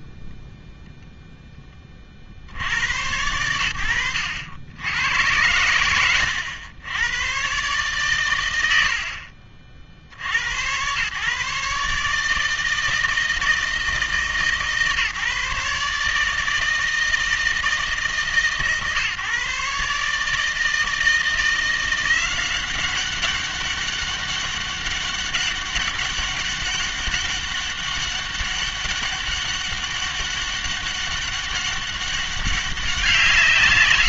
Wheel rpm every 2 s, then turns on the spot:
10, 90, 80, 100, 90, 100, 160, 150, 160, 140, 160, 190, 200, 200, 200, 200, 180.
0-2